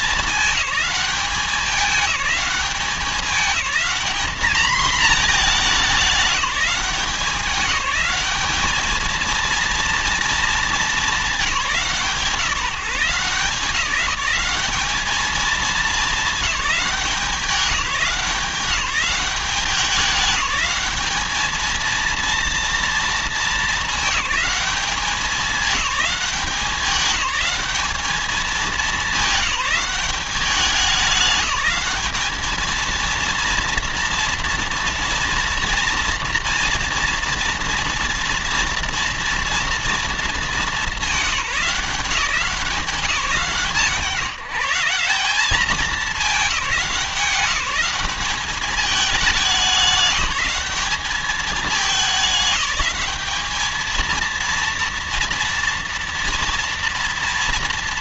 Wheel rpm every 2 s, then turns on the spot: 200, 200, 230, 180, 220, 210, 170, 210, 190, 200, 210, 230, 200, 180, 210, 200, 230, 230, 230, 230, 190, 160, 190, 190, 210, 210, 220, 230, 230.
none